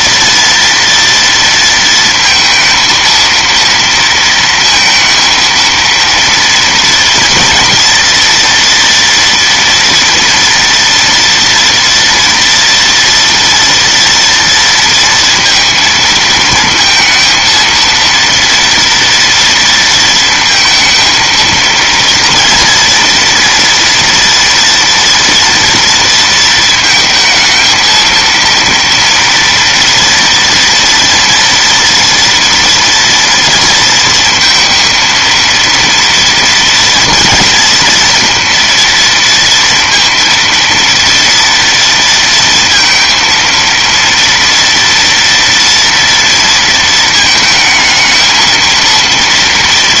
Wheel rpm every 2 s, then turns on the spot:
230, 220, 230, 240, 240, 230, 230, 230, 220, 230, 220, 230, 230, 220, 230, 230, 230, 230, 230, 230, 230, 230, 230, 230, 230.
none